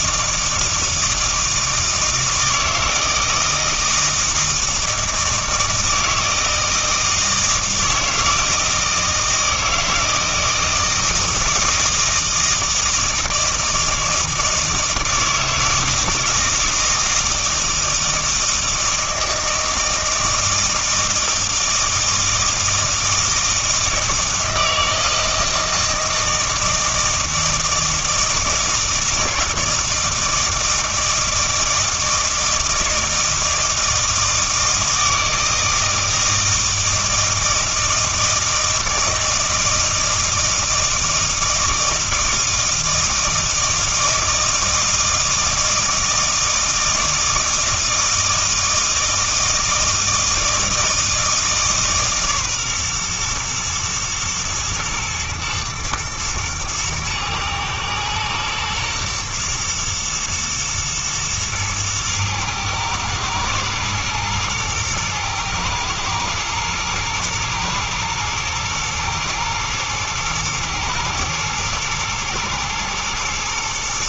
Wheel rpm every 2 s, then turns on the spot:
160, 160, 160, 160, 160, 160, 160, 160, 160, 160, 160, 160, 160, 160, 160, 160, 160, 160, 160, 160, 160, 160, 160, 160, 160, 160, 130, 110, 120, 120, 110, 110, 110, 110, 110, 110, 110.
none